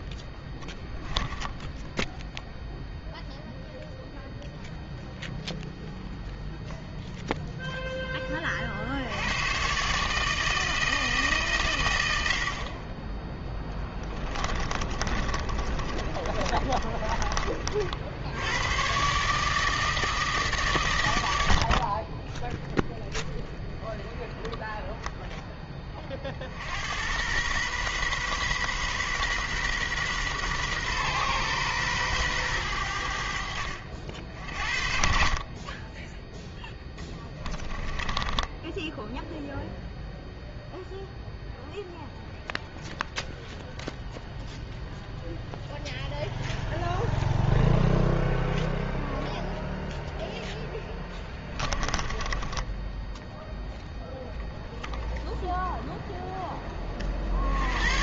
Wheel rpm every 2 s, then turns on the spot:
10, 0, 0, 0, 60, 160, 40, 30, 30, 110, 130, 10, 10, 80, 130, 130, 100, 50, 10, 10, 0, 0, 0, 0, 0, 10, 10, 10, 30.
0-2 14-18 24-26 36-40 52-54